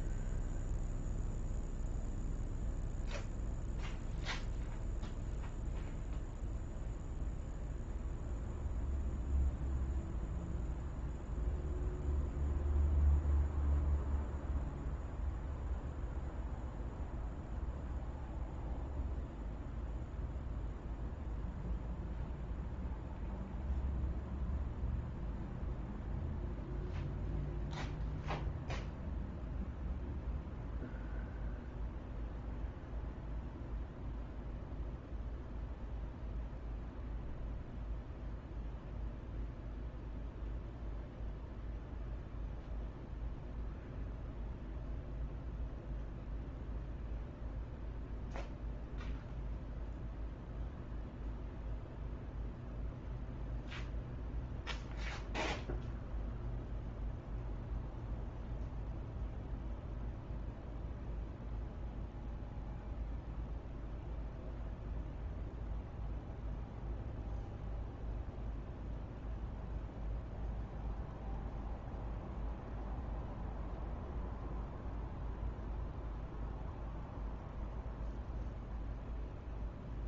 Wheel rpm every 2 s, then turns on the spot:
0, 0, 0, 0, 0, 0, 0, 0, 0, 0, 0, 0, 0, 0, 0, 0, 0, 0, 0, 0, 0, 0, 0, 0, 0, 0, 0, 0, 0, 0, 0, 0, 0, 0, 0, 0, 0, 0, 0, 0.
none